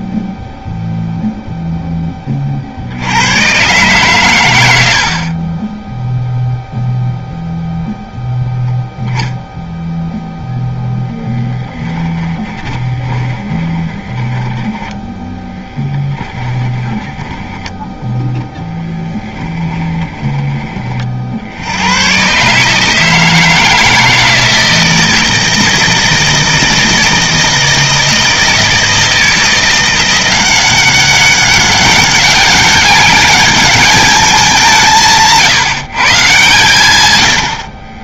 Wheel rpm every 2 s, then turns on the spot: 0, 120, 20, 0, 0, 10, 10, 10, 10, 20, 70, 160, 160, 160, 170, 190, 200, 170, 80.
10-20